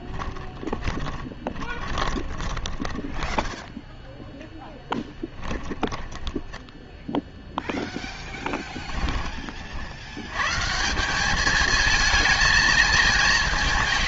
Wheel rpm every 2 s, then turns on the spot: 20, 20, 10, 10, 10, 130, 220.
0-8